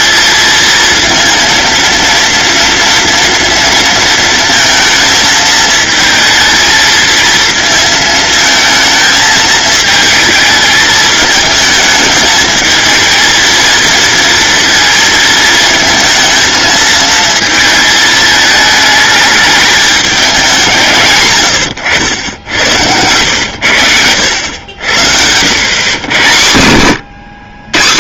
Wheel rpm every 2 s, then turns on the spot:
230, 230, 220, 220, 220, 220, 220, 230, 220, 220, 140, 100, 80, 120.
none